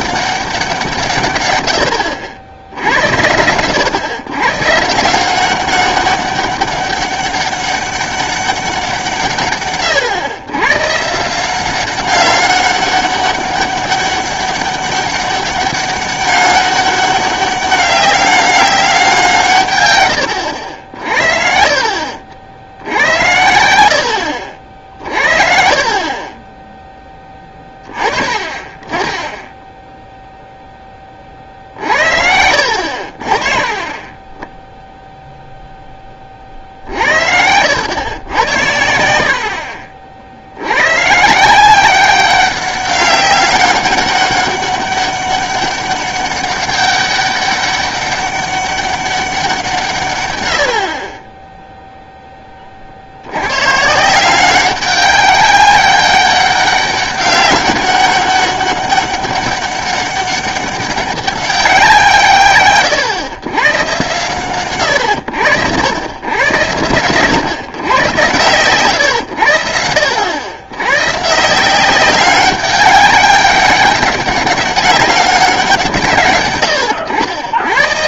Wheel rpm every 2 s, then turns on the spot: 180, 70, 130, 200, 190, 120, 200, 200, 200, 200, 90, 70, 60, 10, 30, 0, 70, 10, 50, 90, 90, 190, 200, 200, 200, 80, 20, 190, 200, 200, 200, 140, 130, 100, 110, 100, 190, 210, 120.
32-34